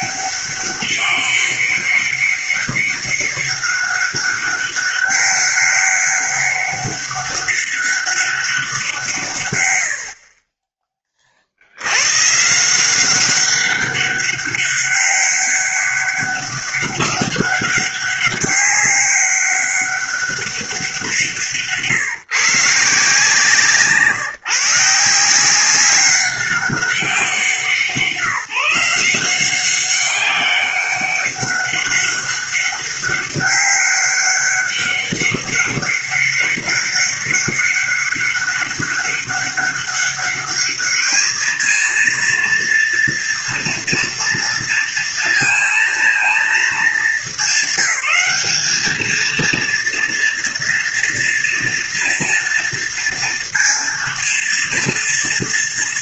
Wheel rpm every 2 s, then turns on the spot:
200, 200, 200, 200, 190, 30, 160, 200, 200, 200, 190, 150, 160, 190, 170, 190, 200, 200, 200, 200, 210, 230, 230, 220, 200, 230, 230, 230.
none